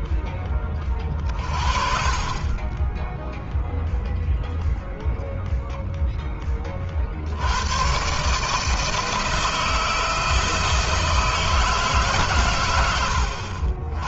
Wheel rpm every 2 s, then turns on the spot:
30, 0, 0, 70, 160, 160, 90.
none